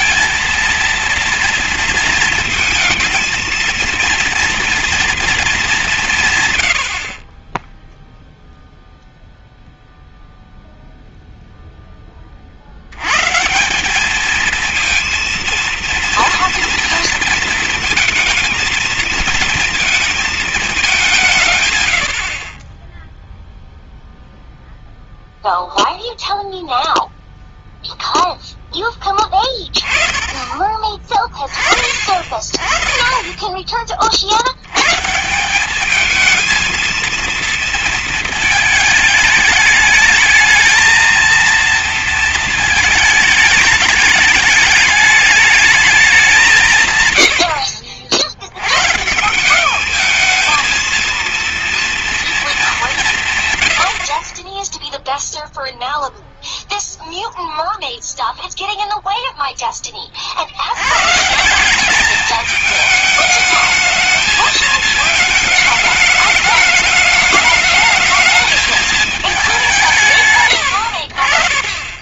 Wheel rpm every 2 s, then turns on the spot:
230, 220, 230, 120, 0, 0, 50, 220, 230, 220, 220, 40, 0, 0, 0, 20, 30, 90, 220, 220, 220, 230, 210, 180, 90, 230, 230, 30, 0, 0, 60, 210, 220, 210, 220, 90.
none